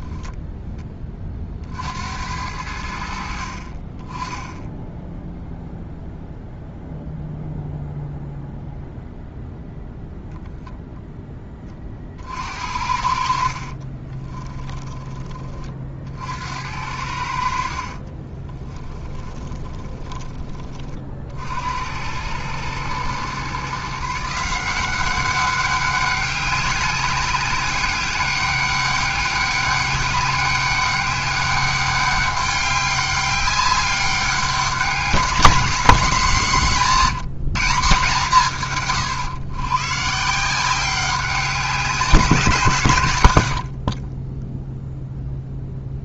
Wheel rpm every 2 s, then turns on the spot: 10, 80, 0, 0, 0, 0, 60, 20, 70, 20, 30, 110, 170, 200, 200, 200, 200, 190, 190, 140, 190, 160, 0.
18-20